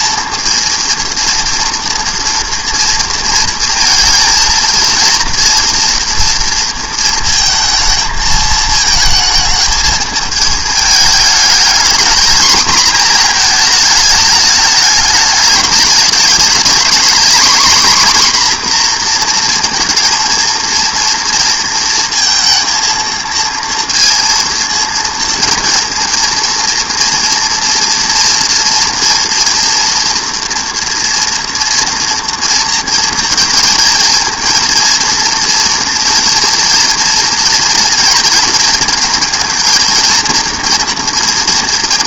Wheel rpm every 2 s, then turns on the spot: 230, 230, 230, 230, 220, 220, 230, 210, 230, 250, 230, 230, 230, 230, 230, 230, 230, 230, 230, 230, 240.
none